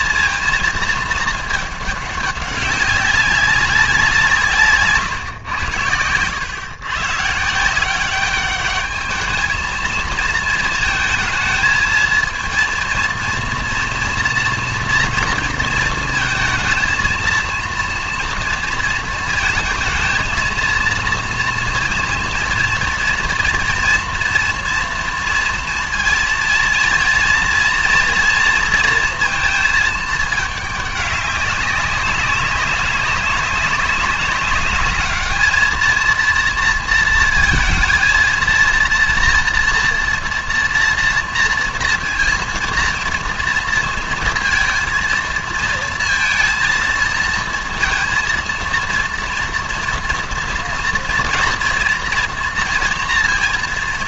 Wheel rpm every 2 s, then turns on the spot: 220, 200, 140, 120, 200, 220, 230, 230, 230, 230, 230, 230, 230, 230, 230, 200, 200, 210, 230, 230, 230, 230, 230, 230, 230, 230, 230.
none